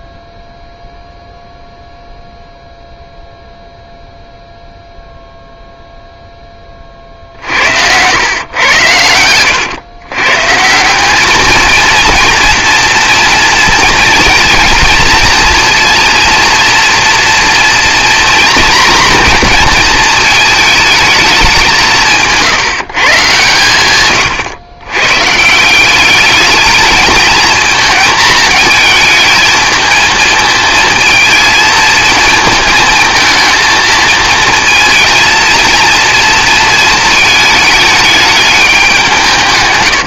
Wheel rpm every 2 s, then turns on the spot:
0, 0, 0, 40, 110, 170, 230, 230, 240, 240, 220, 150, 110, 220, 220, 220, 230, 230, 220, 200.
none